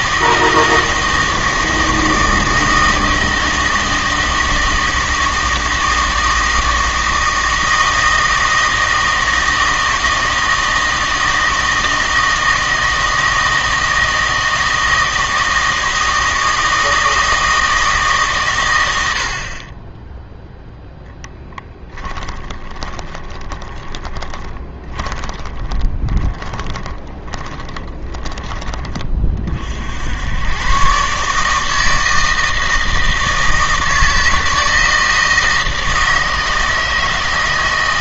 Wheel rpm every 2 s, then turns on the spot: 160, 160, 160, 160, 160, 160, 160, 160, 160, 110, 0, 20, 20, 20, 20, 120, 160, 160, 160.
22-28